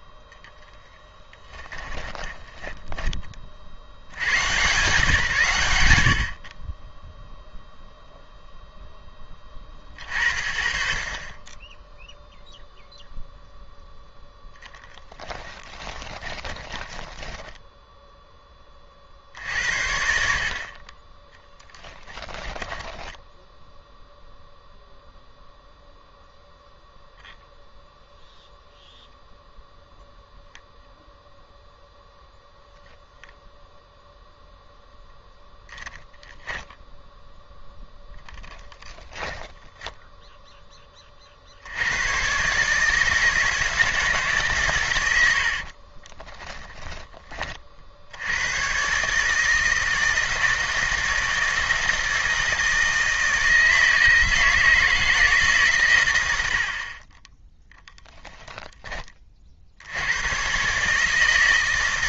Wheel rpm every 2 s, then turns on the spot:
10, 10, 130, 40, 10, 30, 0, 10, 10, 30, 40, 10, 0, 0, 0, 0, 0, 0, 0, 10, 20, 150, 120, 10, 130, 160, 160, 160, 50, 20, 140.
0-4 14-18 22-24 38-40